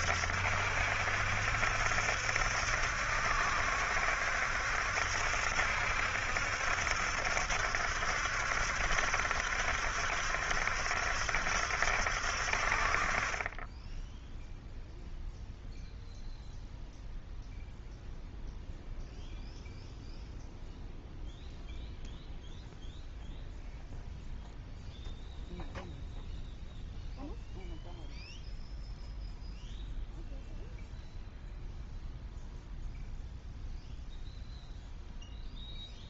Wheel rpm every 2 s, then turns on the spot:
70, 70, 70, 70, 70, 70, 50, 0, 0, 0, 0, 0, 0, 0, 0, 0, 0, 0.
none